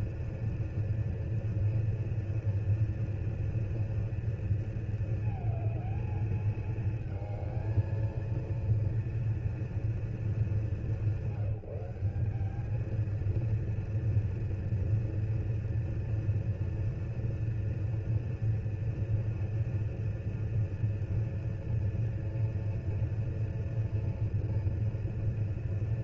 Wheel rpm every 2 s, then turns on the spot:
230, 230, 230, 220, 230, 190, 210, 240, 230, 230, 230, 230, 240.
none